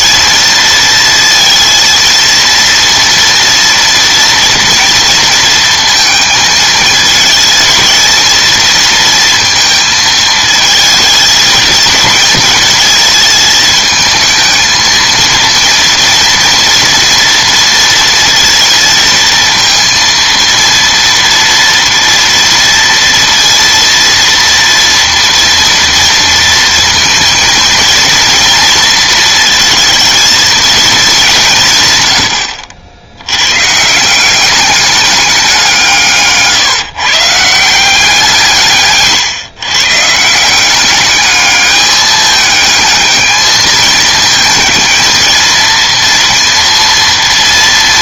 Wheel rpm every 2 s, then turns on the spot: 230, 240, 230, 220, 230, 220, 220, 220, 230, 230, 230, 230, 230, 230, 230, 220, 70, 200, 140, 150, 180, 210, 220, 230.
none